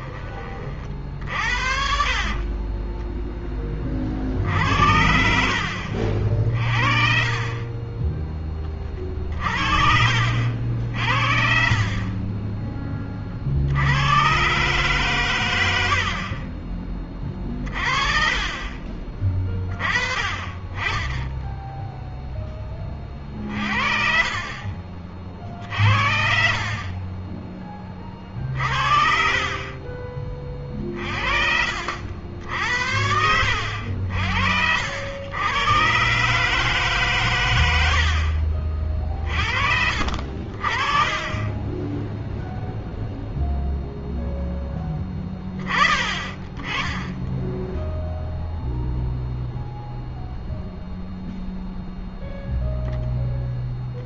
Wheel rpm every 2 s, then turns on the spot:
30, 20, 60, 60, 20, 50, 20, 130, 30, 30, 20, 20, 60, 30, 40, 30, 70, 70, 140, 40, 50, 0, 0, 10, 0, 0, 0.
2-4 18-20 28-30